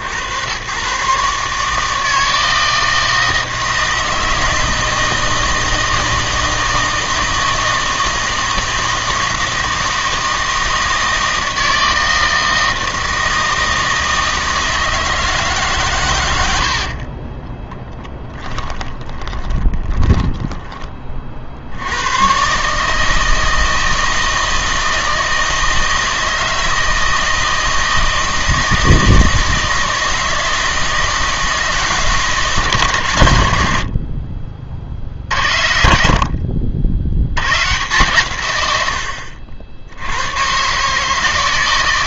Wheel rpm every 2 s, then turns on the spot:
100, 160, 160, 160, 160, 160, 160, 160, 70, 20, 20, 140, 160, 160, 160, 160, 140, 50, 60, 110, 140.
18-20